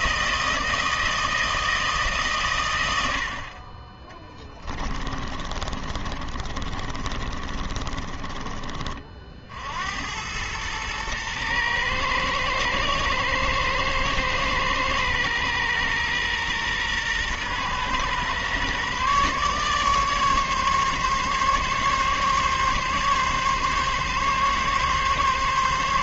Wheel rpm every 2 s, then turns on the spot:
160, 90, 20, 40, 40, 110, 120, 110, 120, 140, 140, 140, 140.
4-8